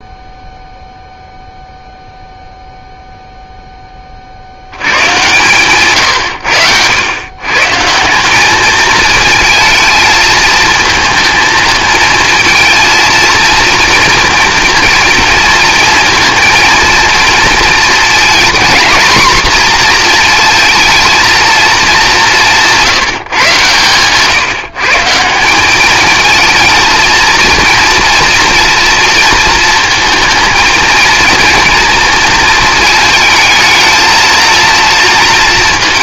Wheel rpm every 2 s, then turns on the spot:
0, 0, 100, 110, 210, 220, 230, 230, 230, 240, 220, 170, 150, 230, 230, 230, 220, 230.
none